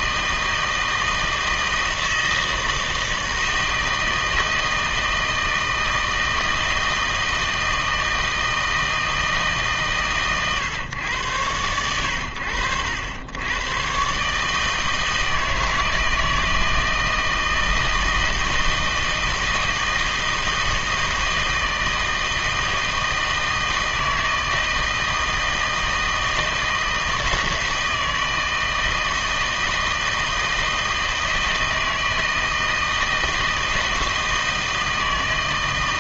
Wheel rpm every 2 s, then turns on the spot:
160, 160, 160, 160, 160, 120, 80, 160, 160, 160, 160, 160, 160, 160, 160, 160, 160, 160.
none